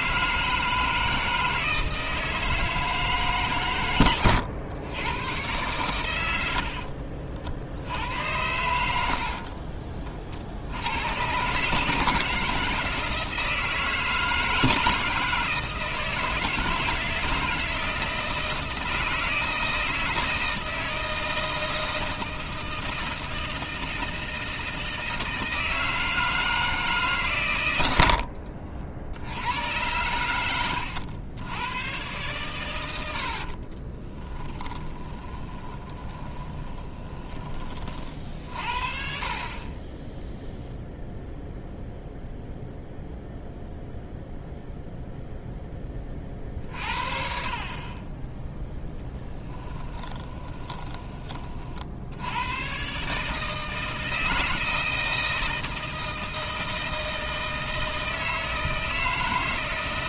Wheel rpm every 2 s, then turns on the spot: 160, 160, 110, 70, 80, 80, 160, 160, 160, 160, 160, 160, 160, 160, 70, 100, 90, 20, 20, 60, 0, 0, 0, 50, 0, 20, 130, 160, 160, 160.
6-8 34-38 50-52